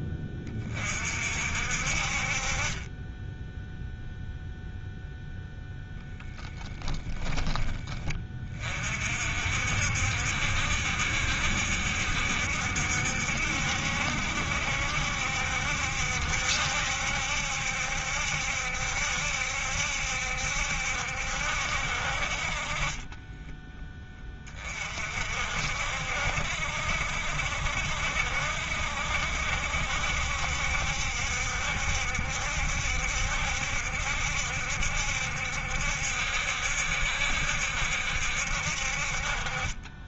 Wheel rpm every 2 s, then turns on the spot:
30, 30, 0, 0, 30, 70, 70, 70, 70, 70, 70, 40, 30, 70, 70, 70, 70, 70, 70, 60.
none